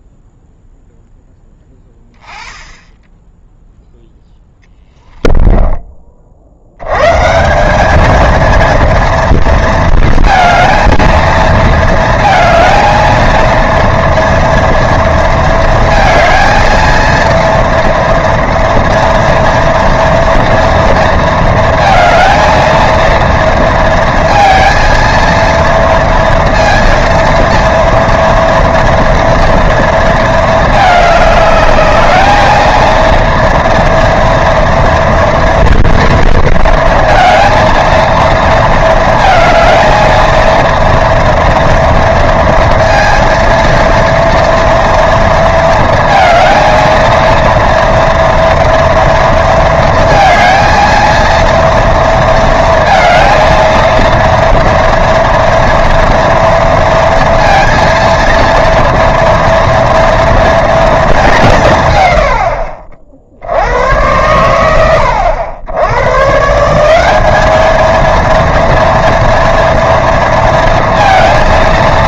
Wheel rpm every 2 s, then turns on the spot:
10, 10, 10, 120, 230, 230, 230, 230, 230, 230, 230, 230, 230, 230, 230, 210, 230, 230, 230, 220, 230, 230, 230, 230, 230, 230, 220, 230, 230, 230, 220, 60, 90, 190, 230, 230.
4-6